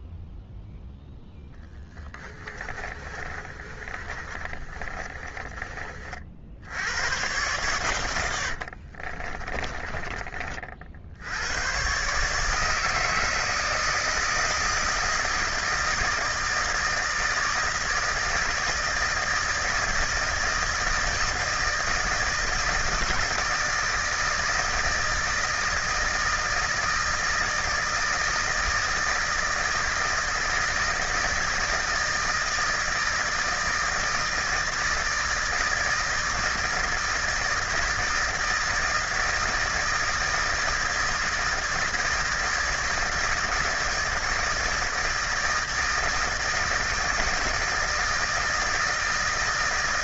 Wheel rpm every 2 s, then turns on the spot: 0, 30, 30, 80, 50, 50, 150, 160, 160, 160, 160, 160, 160, 160, 160, 160, 160, 160, 160, 160, 160, 160, 160, 160, 160.
2-6 8-10